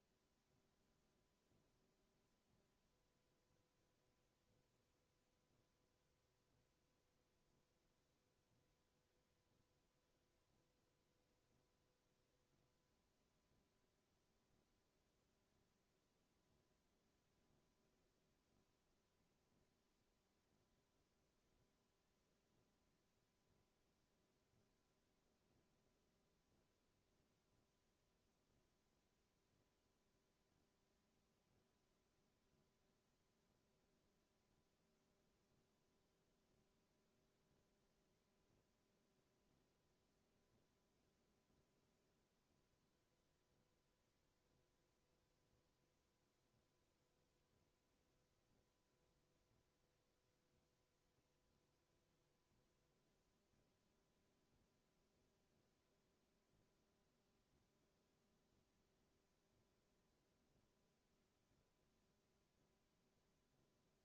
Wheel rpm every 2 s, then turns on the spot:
0, 0, 0, 0, 0, 0, 0, 0, 0, 0, 0, 0, 0, 0, 0, 0, 0, 0, 0, 0, 0, 0, 0, 0, 0, 0, 0, 0, 0, 0, 0, 0.
none